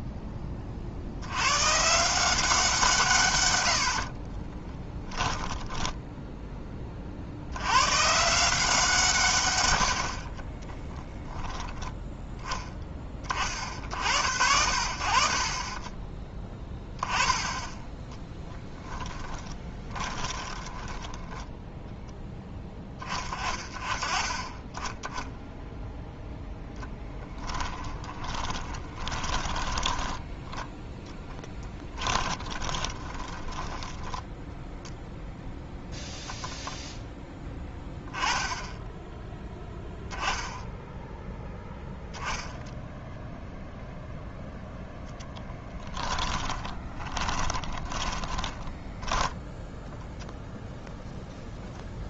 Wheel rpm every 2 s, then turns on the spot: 40, 170, 20, 10, 160, 20, 10, 70, 30, 10, 20, 10, 10, 10, 20, 10, 20, 0, 10, 10, 10, 0, 0, 30, 10, 0.
4-6 10-12 18-22 28-30 32-34 46-50